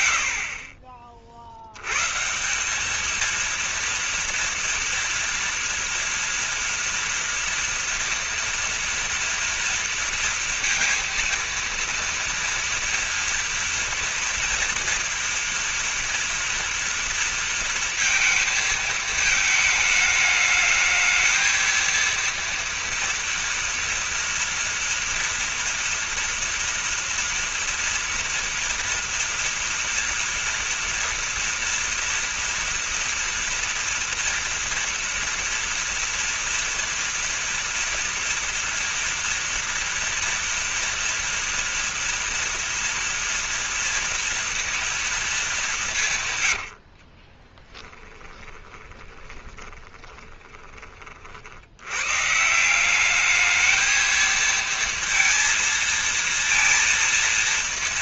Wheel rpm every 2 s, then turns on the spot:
80, 150, 230, 230, 230, 230, 230, 230, 230, 230, 210, 230, 230, 230, 230, 230, 230, 230, 230, 230, 230, 230, 230, 140, 20, 20, 130, 230, 230.
48-52